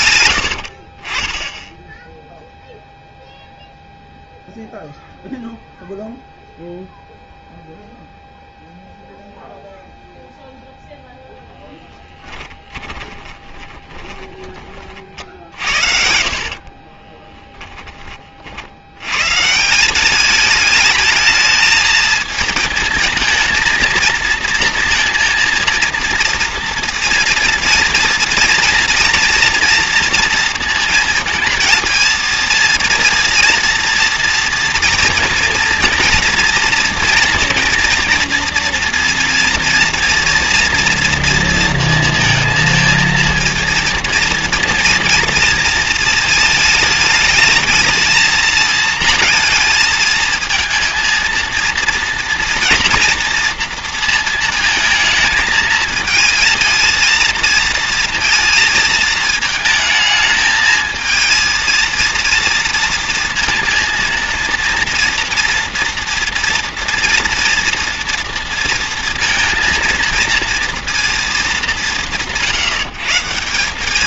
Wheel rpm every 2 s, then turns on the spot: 60, 0, 0, 0, 0, 0, 20, 40, 40, 70, 210, 220, 230, 230, 240, 230, 230, 230, 230, 230, 230, 230, 230, 220, 230, 230, 230, 220, 230, 230, 220, 230, 230, 230, 230, 230, 150.
0-2 12-14 16-18